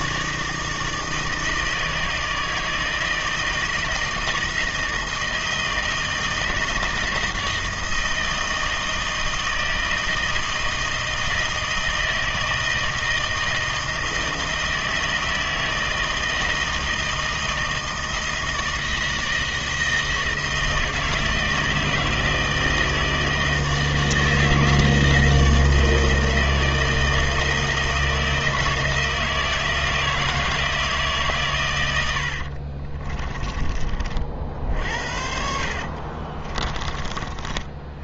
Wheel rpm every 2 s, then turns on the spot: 160, 160, 160, 160, 160, 160, 160, 160, 160, 160, 160, 160, 160, 160, 160, 160, 40, 60, 30.
32-34 36-38